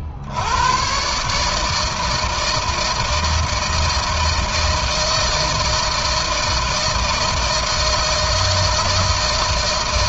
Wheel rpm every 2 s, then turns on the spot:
110, 160, 170, 160, 160.
none